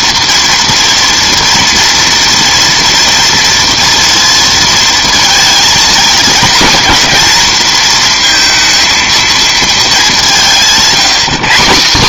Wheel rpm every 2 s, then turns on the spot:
230, 230, 230, 230, 230, 190.
none